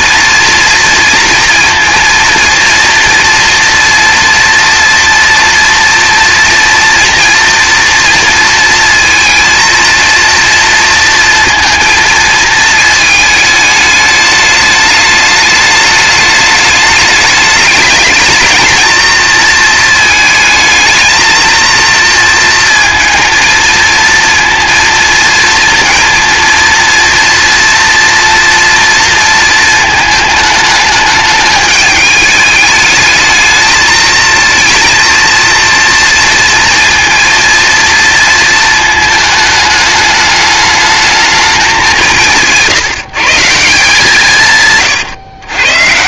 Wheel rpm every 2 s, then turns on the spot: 230, 230, 230, 230, 230, 230, 220, 210, 210, 230, 220, 230, 230, 230, 230, 220, 210, 230, 230, 220, 220, 150, 140.
44-46